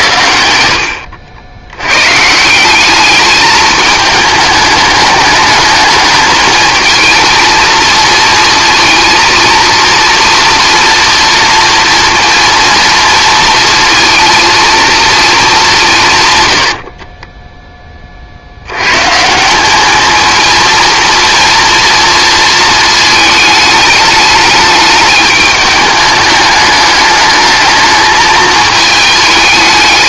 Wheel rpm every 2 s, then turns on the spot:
80, 200, 210, 220, 230, 230, 230, 230, 60, 120, 230, 220, 210, 210, 220.
16-18